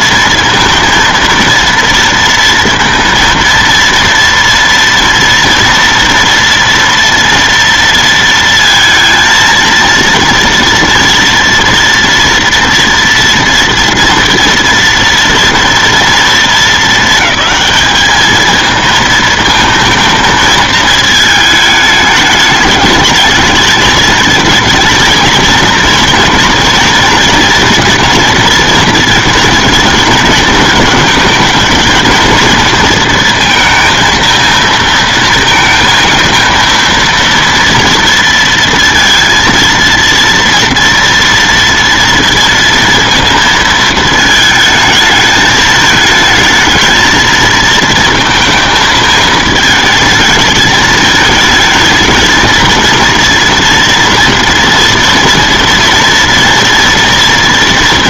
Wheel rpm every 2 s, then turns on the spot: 230, 230, 230, 230, 230, 230, 230, 230, 220, 220, 220, 210, 220, 230, 220, 220, 230, 230, 230, 230, 230, 230, 220, 220, 220, 210, 230, 240, 240.
none